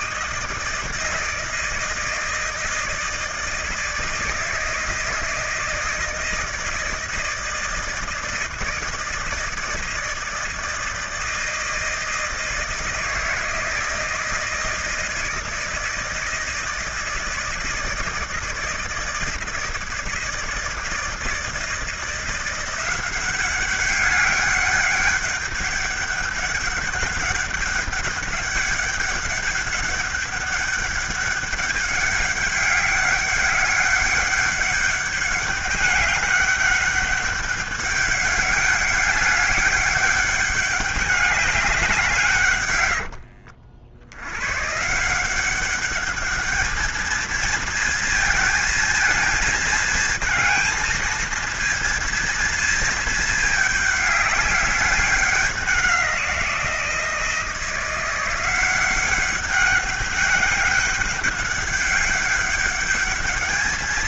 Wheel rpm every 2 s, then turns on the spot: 160, 160, 160, 160, 160, 170, 160, 160, 160, 160, 160, 180, 200, 200, 200, 200, 200, 200, 200, 200, 200, 120, 130, 210, 220, 220, 220, 200, 170, 190, 200, 200.
42-44